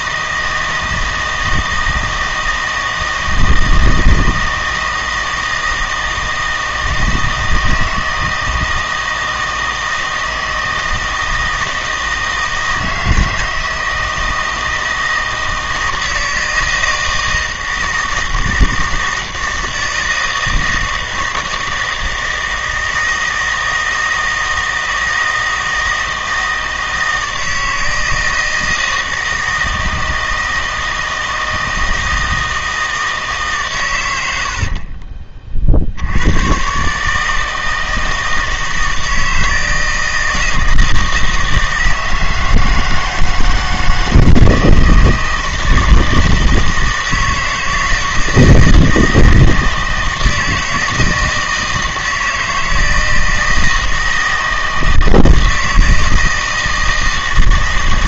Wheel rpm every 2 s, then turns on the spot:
160, 160, 160, 160, 160, 160, 160, 160, 160, 160, 160, 160, 160, 160, 160, 160, 160, 50, 130, 160, 160, 160, 160, 160, 160, 160, 160, 160, 160.
34-36